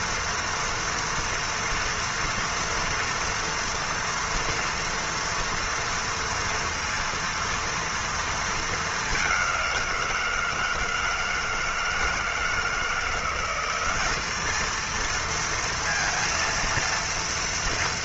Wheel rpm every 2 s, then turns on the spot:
230, 230, 230, 230, 230, 170, 160, 200, 230.
none